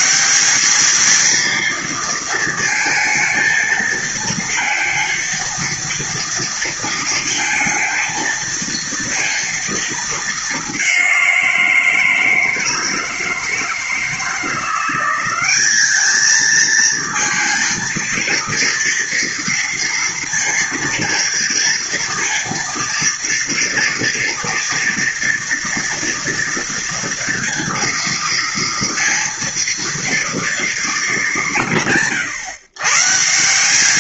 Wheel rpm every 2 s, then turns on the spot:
210, 230, 230, 230, 230, 200, 160, 180, 220, 230, 230, 230, 230, 230, 230, 230, 140.
none